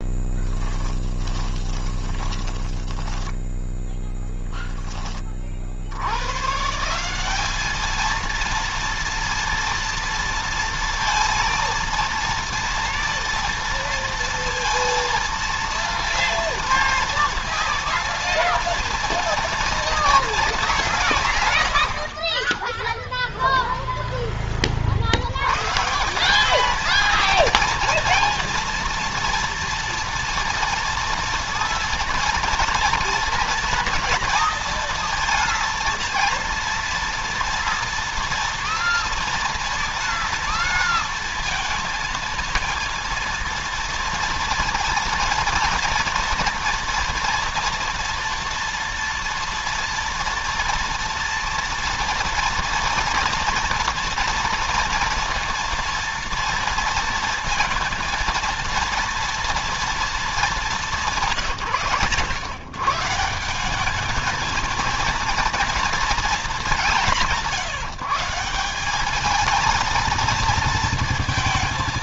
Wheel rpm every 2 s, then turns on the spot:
10, 10, 0, 150, 230, 230, 230, 230, 230, 240, 210, 20, 30, 210, 230, 230, 230, 230, 230, 230, 230, 230, 230, 230, 230, 240, 230, 230, 230, 230, 190, 120, 220, 220, 180, 230.
0-4